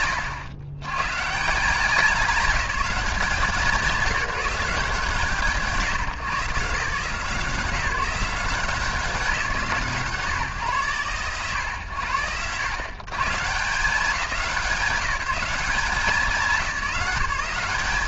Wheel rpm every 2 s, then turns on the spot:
110, 180, 160, 160, 170, 140, 130, 180, 190.
none